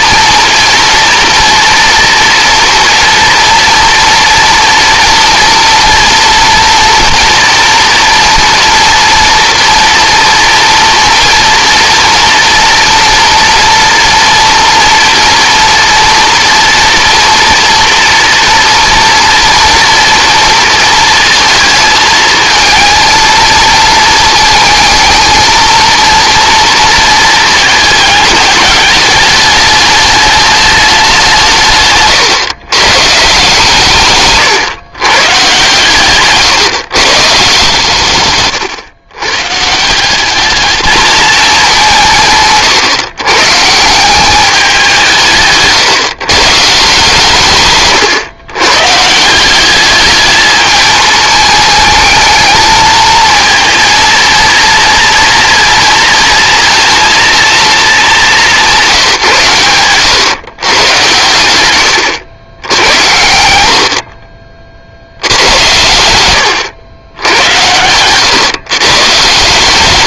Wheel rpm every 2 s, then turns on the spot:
230, 230, 230, 230, 240, 230, 230, 230, 230, 240, 230, 220, 220, 230, 210, 210, 120, 130, 140, 130, 210, 130, 190, 150, 140, 220, 220, 230, 230, 180, 120, 80, 60, 100, 130.
none